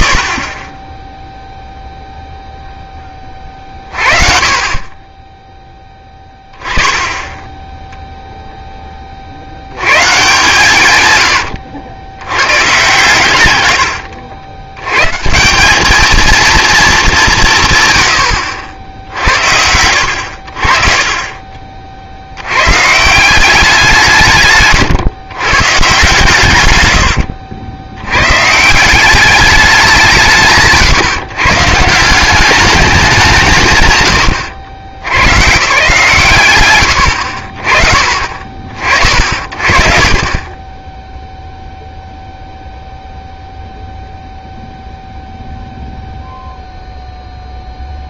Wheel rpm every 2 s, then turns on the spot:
20, 10, 30, 10, 10, 160, 110, 100, 230, 80, 50, 100, 140, 100, 150, 150, 200, 90, 130, 50, 20, 0, 0, 0.
24-26